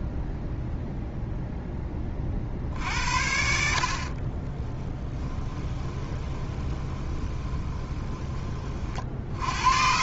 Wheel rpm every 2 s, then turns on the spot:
0, 50, 20, 20, 30.
4-8